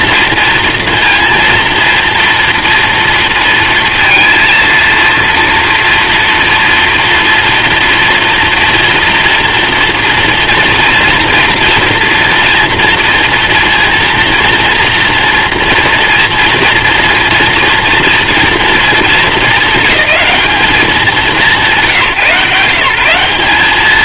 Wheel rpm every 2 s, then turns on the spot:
230, 230, 230, 230, 230, 230, 230, 230, 230, 220, 200, 140.
none